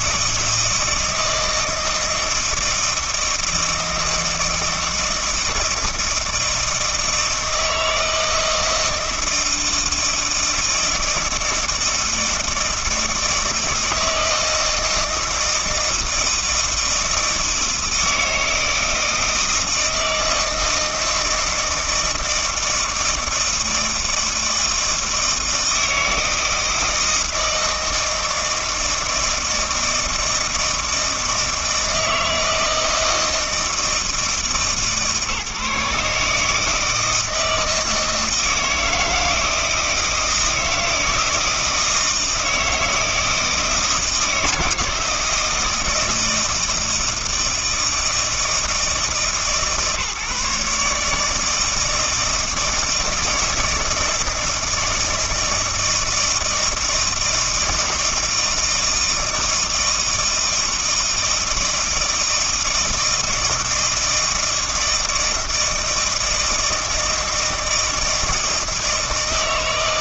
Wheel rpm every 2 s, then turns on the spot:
160, 160, 160, 160, 160, 160, 160, 160, 160, 160, 160, 160, 160, 160, 160, 160, 160, 150, 160, 160, 160, 160, 160, 160, 160, 150, 160, 160, 160, 160, 160, 160, 160, 160, 160.
none